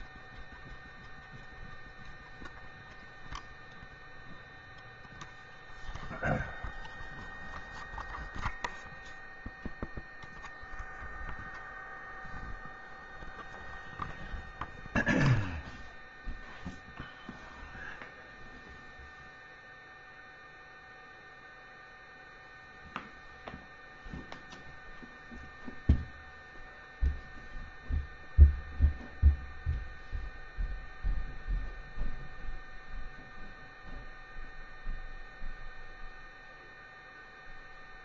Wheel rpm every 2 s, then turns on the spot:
0, 0, 0, 0, 0, 0, 0, 0, 0, 0, 0, 0, 0, 0, 0, 0, 0, 0, 0.
none